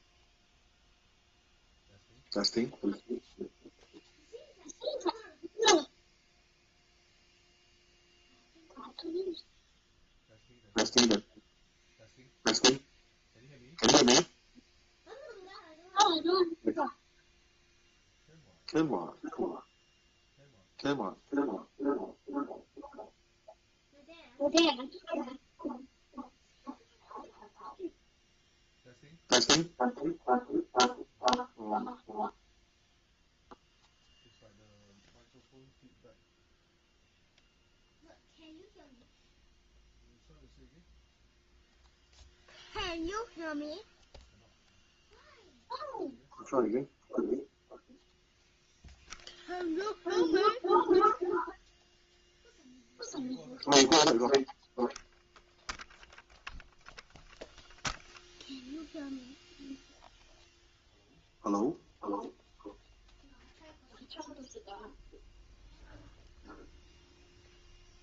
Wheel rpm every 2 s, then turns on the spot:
0, 0, 0, 0, 0, 0, 0, 0, 0, 0, 0, 0, 0, 0, 0, 0, 0, 0, 0, 0, 0, 0, 0, 0, 0, 0, 0, 0, 0, 0, 0, 0, 0, 0.
none